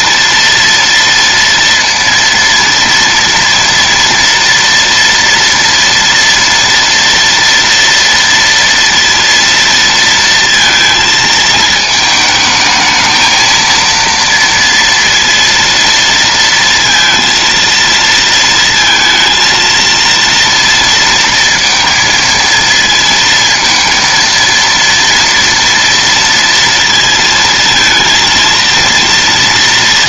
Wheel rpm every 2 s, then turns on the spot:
230, 230, 230, 230, 230, 230, 220, 230, 230, 230, 230, 230, 230, 230, 230.
none